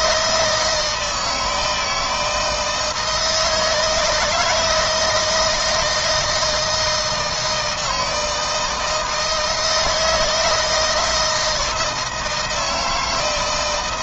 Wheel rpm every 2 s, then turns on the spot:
160, 160, 160, 170, 160, 160, 160.
none